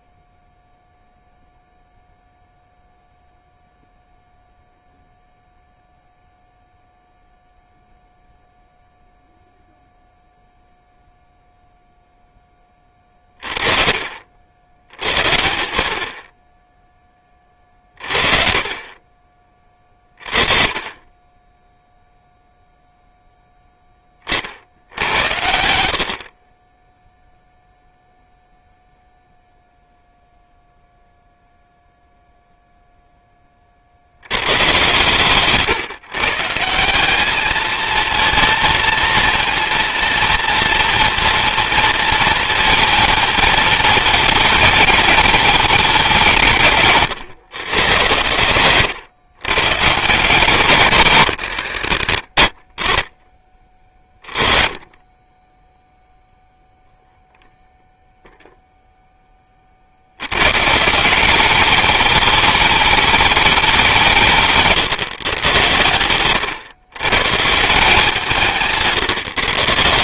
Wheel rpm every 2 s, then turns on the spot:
0, 0, 0, 0, 0, 0, 20, 70, 10, 40, 30, 0, 60, 20, 0, 0, 0, 120, 170, 230, 230, 230, 220, 160, 120, 140, 40, 30, 0, 0, 140, 210, 150, 130, 160.
none